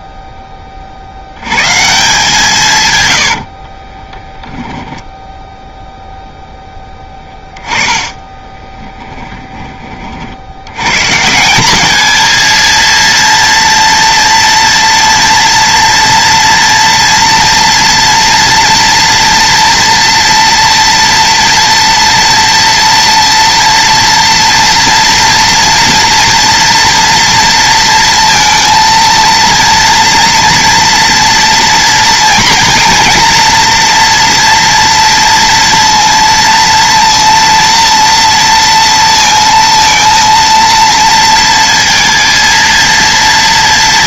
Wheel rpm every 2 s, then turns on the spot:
30, 140, 0, 10, 10, 100, 230, 230, 230, 230, 230, 240, 230, 230, 230, 230, 240, 230, 230, 230, 230, 230.
6-10